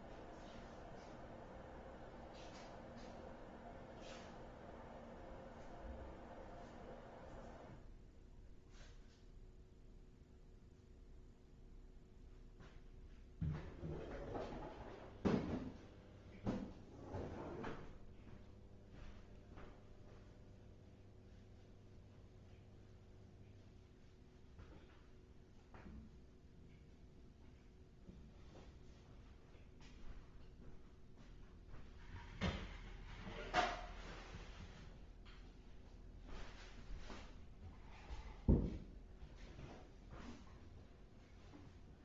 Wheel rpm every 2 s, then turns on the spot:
0, 0, 0, 0, 0, 0, 0, 0, 0, 0, 0, 0, 0, 0, 0, 0, 0, 0, 0, 0, 0.
none